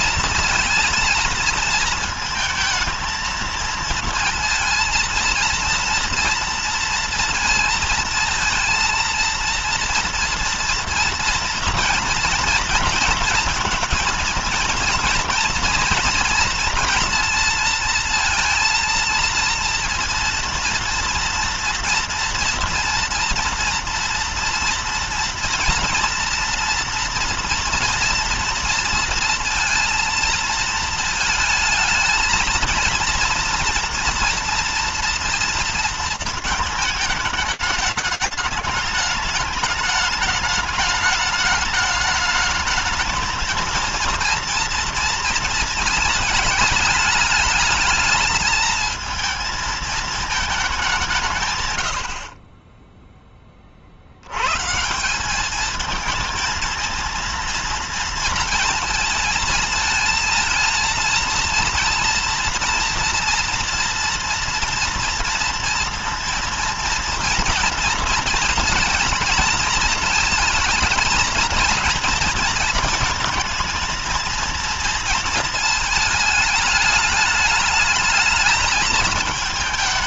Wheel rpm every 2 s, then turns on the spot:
230, 230, 230, 230, 230, 230, 230, 230, 240, 230, 230, 230, 230, 230, 230, 230, 220, 230, 220, 210, 210, 220, 230, 220, 220, 210, 20, 100, 220, 230, 230, 230, 230, 230, 230, 220, 230, 230, 220, 210.
none